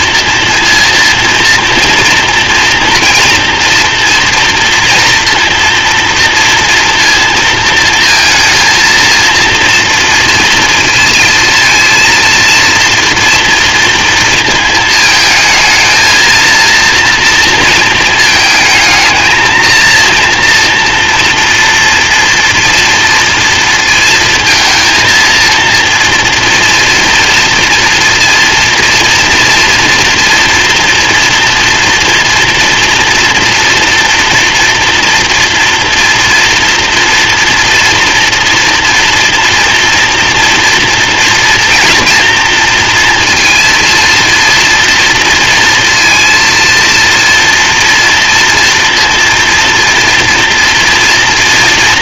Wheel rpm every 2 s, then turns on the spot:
230, 230, 230, 230, 230, 230, 230, 220, 230, 220, 230, 230, 230, 230, 230, 230, 240, 230, 240, 230, 230, 230, 230, 230, 230, 230.
none